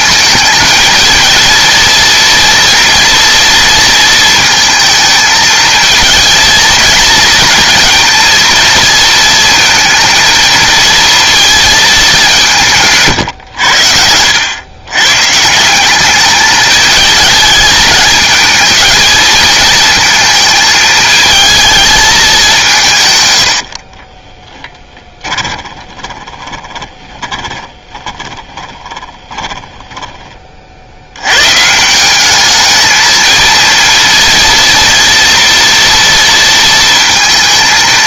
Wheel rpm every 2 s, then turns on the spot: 220, 230, 230, 230, 230, 230, 170, 100, 210, 220, 220, 180, 10, 20, 20, 50, 210, 230, 230.
24-30